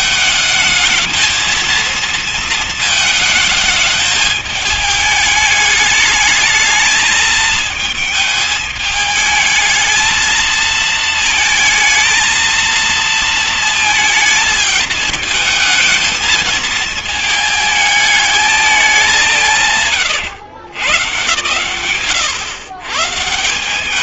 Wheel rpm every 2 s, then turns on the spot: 220, 220, 220, 220, 210, 220, 230, 210, 220, 200, 120, 150.
none